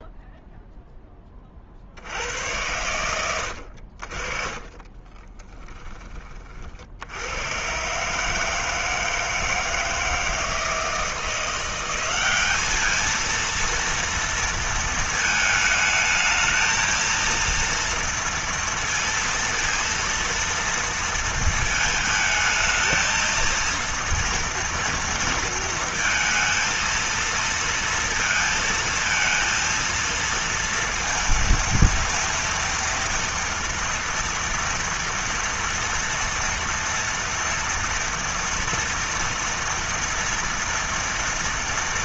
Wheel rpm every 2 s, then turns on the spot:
0, 80, 40, 30, 150, 160, 200, 230, 220, 230, 230, 220, 230, 230, 230, 230, 230, 230, 230, 230, 230.
none